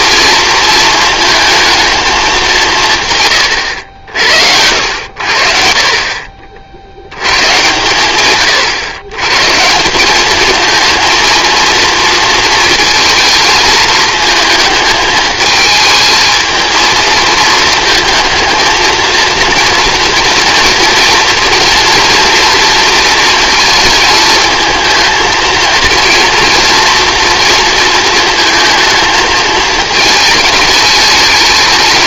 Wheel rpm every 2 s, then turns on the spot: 230, 190, 80, 60, 120, 230, 230, 220, 220, 220, 230, 230, 220, 240, 230, 220.
none